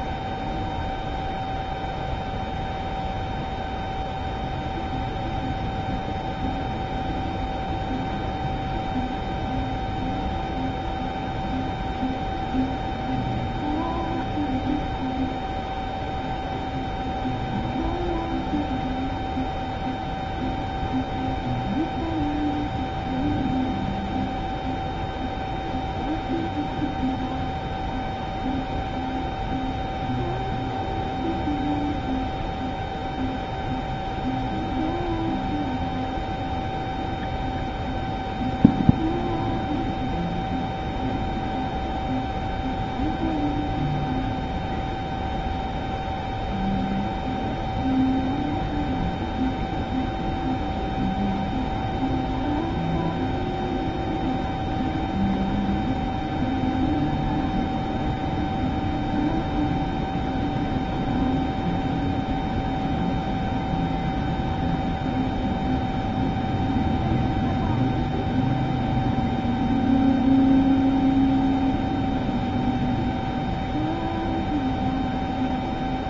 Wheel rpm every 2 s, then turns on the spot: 0, 0, 0, 0, 0, 0, 0, 0, 0, 0, 0, 0, 0, 0, 0, 0, 0, 0, 0, 0, 0, 0, 0, 0, 0, 0, 0, 0, 0, 0, 0, 0, 0, 0, 0, 0, 0, 0.
none